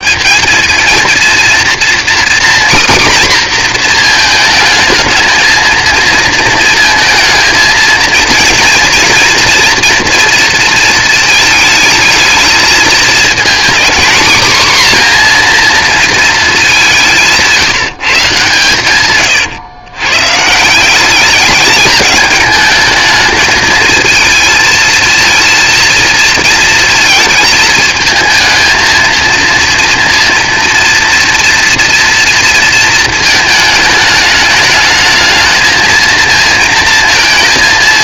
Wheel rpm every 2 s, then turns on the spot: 220, 260, 220, 230, 230, 230, 220, 250, 200, 130, 180, 220, 230, 230, 220, 230, 230, 210, 230.
none